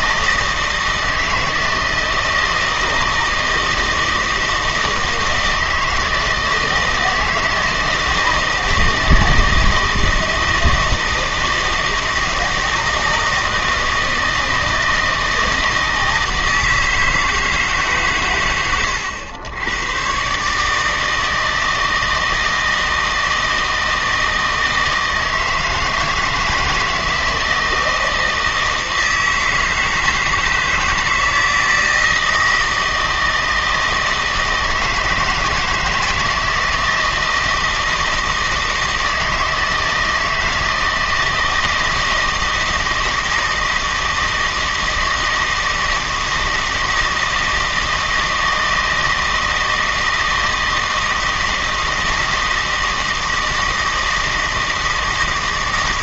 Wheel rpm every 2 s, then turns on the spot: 160, 160, 160, 160, 170, 160, 160, 160, 160, 100, 150, 160, 160, 160, 160, 160, 160, 160, 160, 160, 160, 160, 160, 160, 160, 160, 160, 160.
none